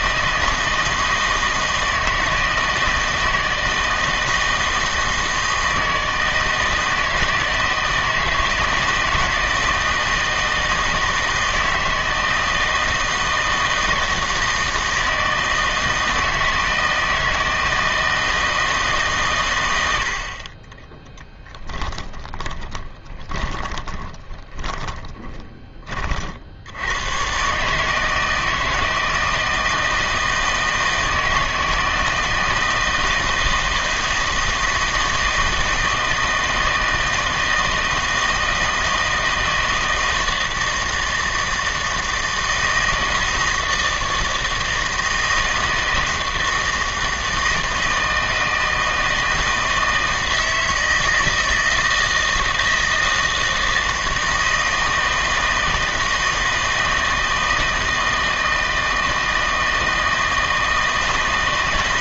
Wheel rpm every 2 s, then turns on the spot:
160, 160, 160, 160, 160, 160, 160, 160, 160, 160, 20, 20, 20, 90, 160, 160, 160, 160, 160, 160, 160, 160, 160, 160, 160, 160, 160, 160, 160, 160, 160.
22-26